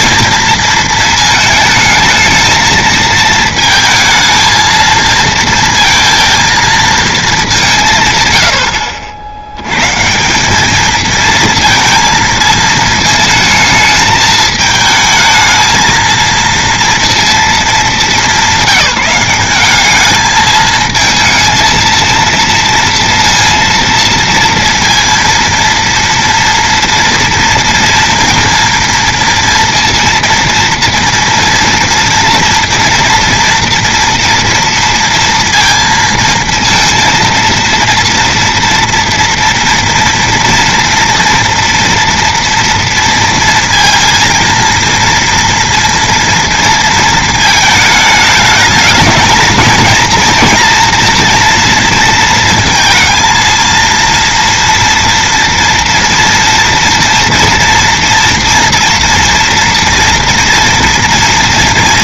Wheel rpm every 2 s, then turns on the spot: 230, 220, 220, 230, 100, 190, 220, 220, 230, 190, 220, 230, 230, 230, 230, 230, 230, 230, 230, 230, 230, 240, 230, 230, 210, 230, 230, 230, 230, 230, 240.
none